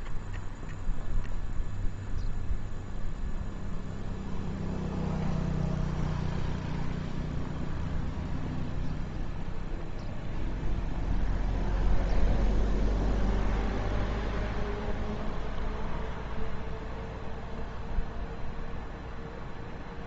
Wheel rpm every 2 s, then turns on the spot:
20, 0, 0, 0, 0, 0, 0, 0, 0, 0.
0-2